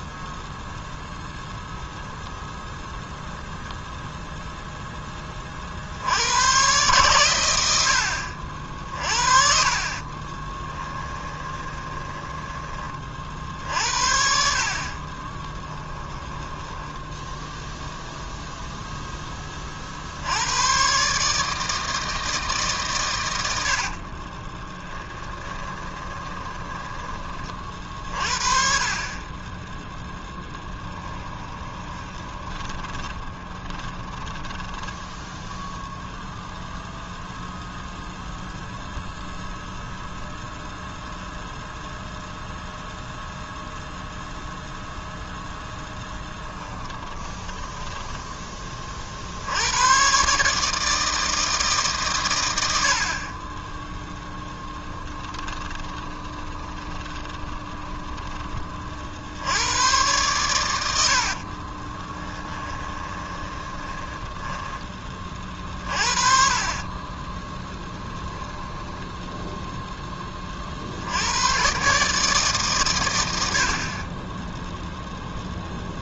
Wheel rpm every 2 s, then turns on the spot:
0, 0, 0, 120, 50, 20, 30, 50, 10, 0, 110, 140, 20, 20, 40, 10, 20, 20, 0, 0, 0, 0, 0, 20, 20, 150, 90, 20, 20, 40, 90, 20, 10, 40, 10, 40, 140, 0.
10-12 16-18 24-28 30-36 46-48 54-58 62-64 66-70